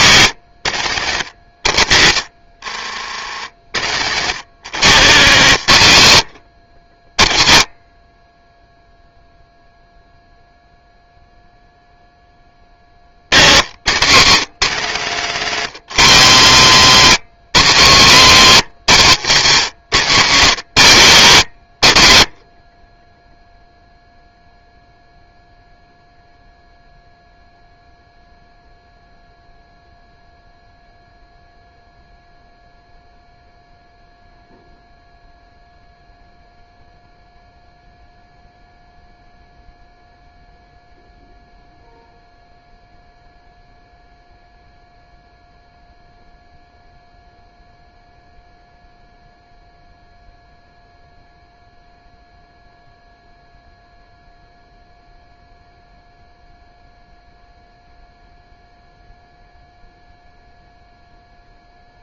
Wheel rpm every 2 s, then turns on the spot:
110, 80, 150, 40, 0, 0, 60, 170, 150, 150, 80, 10, 0, 0, 0, 0, 0, 0, 0, 0, 0, 0, 0, 0, 0, 0, 0, 0, 0, 0, 0.
4-6